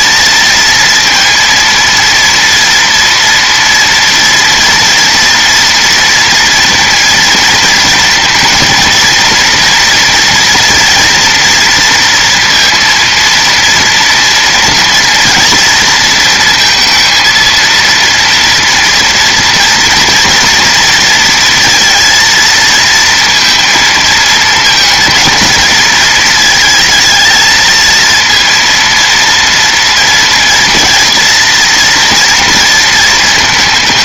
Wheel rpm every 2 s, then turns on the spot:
230, 230, 230, 230, 230, 230, 230, 230, 230, 230, 230, 230, 230, 220, 230, 230, 230.
none